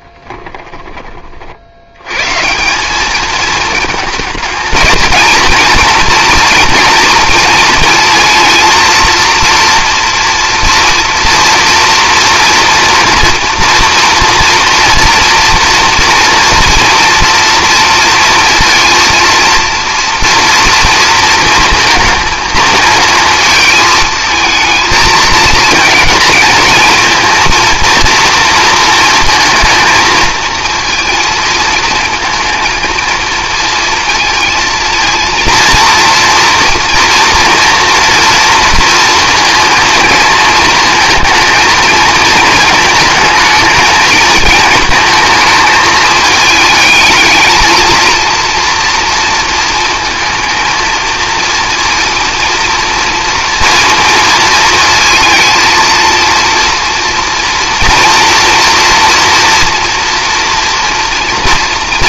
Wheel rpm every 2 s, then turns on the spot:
30, 210, 230, 230, 230, 230, 230, 230, 230, 230, 230, 220, 220, 220, 230, 230, 220, 230, 230, 230, 220, 220, 220, 210, 230, 230, 230, 220, 240, 230, 230.
none